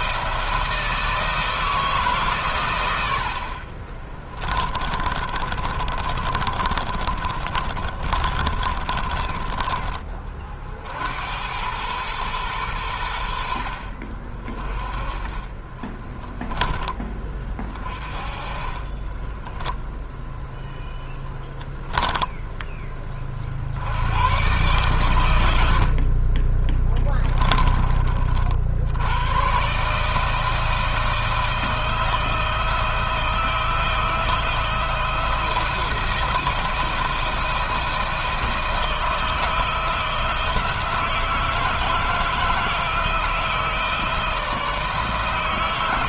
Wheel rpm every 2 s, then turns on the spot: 160, 110, 20, 30, 30, 60, 90, 30, 20, 30, 0, 20, 120, 10, 60, 160, 170, 170, 170, 160, 160, 160, 150.
4-10 18-20 26-28